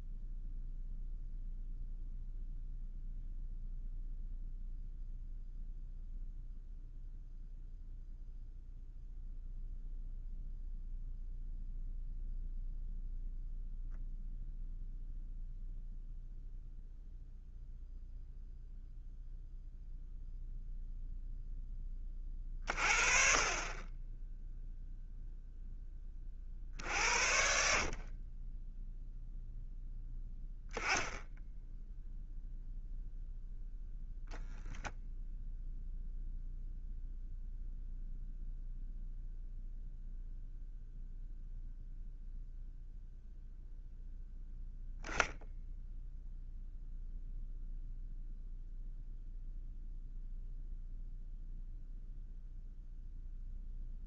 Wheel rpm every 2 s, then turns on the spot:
0, 0, 0, 0, 0, 0, 0, 0, 0, 0, 0, 30, 0, 60, 10, 0, 0, 0, 0, 0, 0, 0, 0, 0, 0, 0, 0.
none